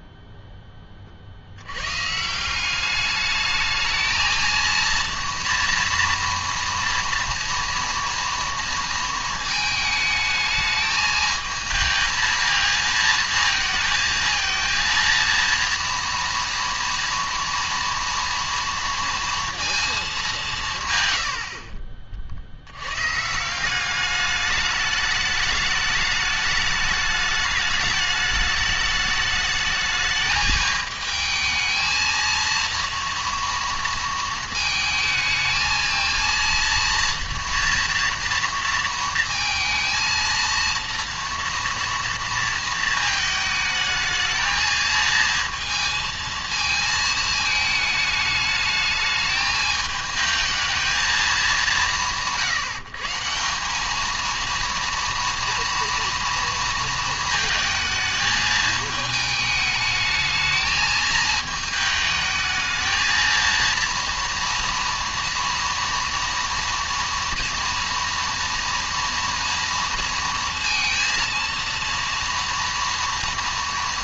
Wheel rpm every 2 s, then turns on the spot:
10, 180, 230, 230, 230, 220, 220, 230, 230, 230, 170, 80, 210, 210, 210, 220, 230, 220, 230, 230, 230, 230, 220, 220, 210, 220, 160, 230, 230, 220, 220, 220, 230, 230, 230, 230, 230.
none